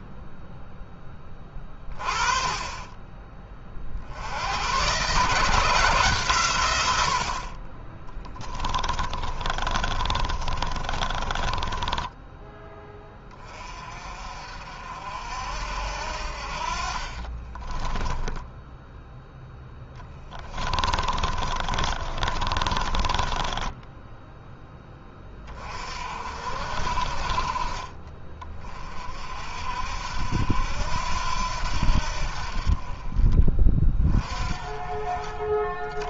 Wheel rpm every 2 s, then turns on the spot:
10, 20, 120, 90, 20, 30, 10, 60, 40, 10, 20, 20, 10, 50, 40, 80, 40, 30.
8-12 16-24